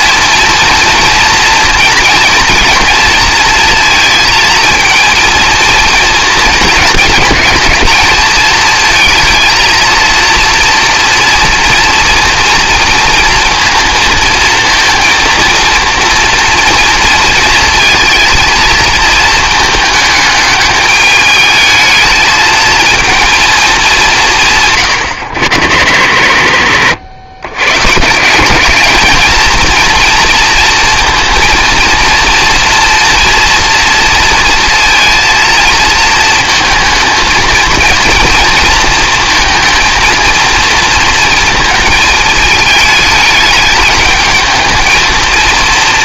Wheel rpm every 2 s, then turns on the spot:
230, 220, 230, 220, 220, 230, 230, 230, 230, 230, 210, 220, 130, 90, 200, 230, 230, 230, 220, 230, 230, 220, 220.
none